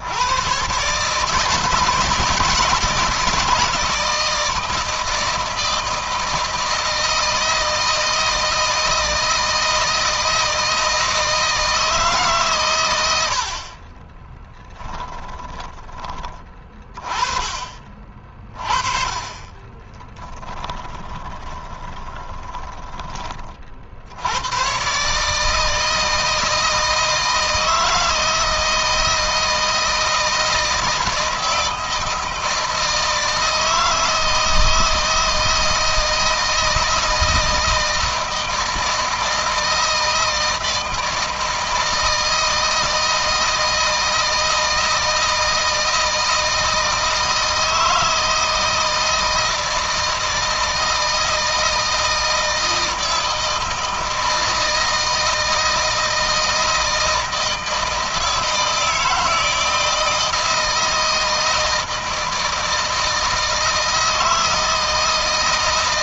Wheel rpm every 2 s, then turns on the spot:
130, 160, 160, 160, 160, 160, 110, 10, 30, 30, 20, 20, 120, 160, 160, 160, 160, 160, 160, 160, 160, 160, 160, 160, 160, 160, 160, 160, 160, 160, 160, 160, 160.
14-16 20-22